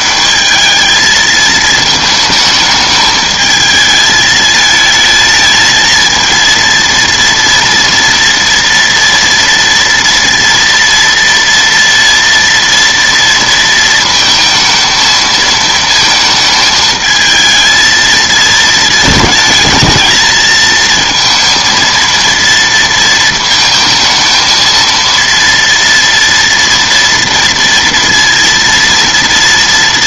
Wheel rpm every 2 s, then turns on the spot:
210, 220, 220, 230, 230, 230, 230, 230, 220, 220, 220, 230, 220, 230, 230.
none